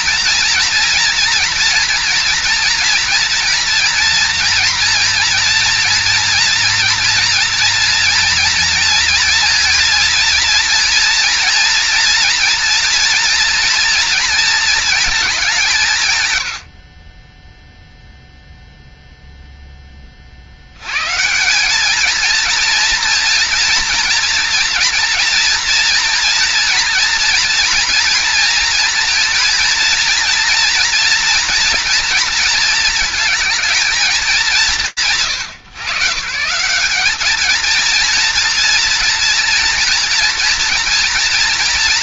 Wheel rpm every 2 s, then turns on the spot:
230, 240, 230, 240, 230, 230, 230, 230, 80, 0, 80, 230, 230, 240, 240, 240, 230, 170, 150, 230, 230.
none